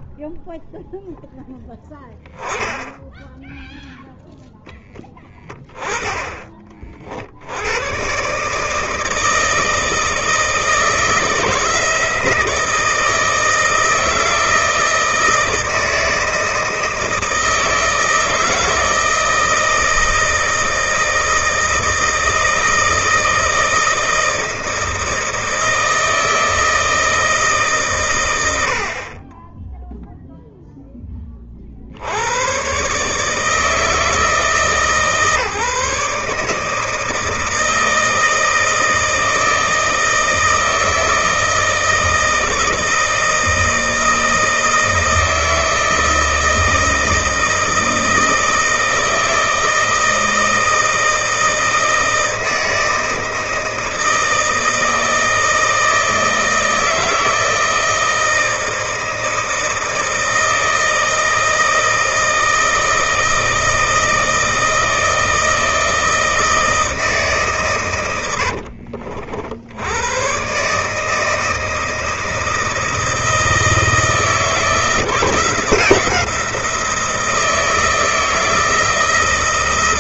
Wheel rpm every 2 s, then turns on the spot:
0, 10, 0, 30, 140, 160, 160, 160, 160, 160, 160, 160, 160, 160, 100, 0, 110, 160, 150, 160, 160, 160, 160, 160, 160, 160, 160, 160, 160, 160, 160, 160, 160, 160, 70, 130, 160, 160, 170, 170.
68-70